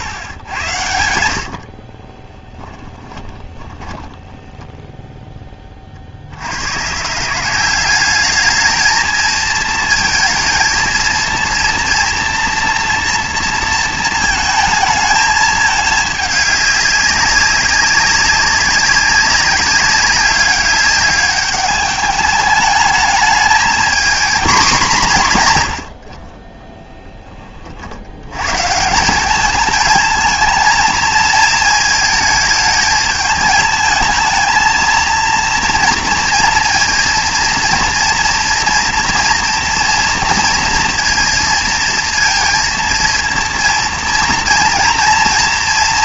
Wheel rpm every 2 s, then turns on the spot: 100, 10, 10, 110, 220, 230, 230, 220, 200, 190, 200, 210, 210, 20, 150, 220, 220, 220, 230, 240, 230, 230, 230.
0-4